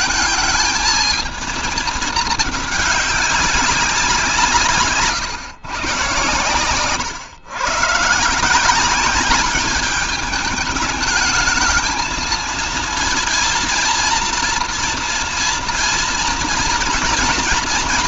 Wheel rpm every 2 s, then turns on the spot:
220, 210, 150, 120, 180, 220, 230, 230, 220.
none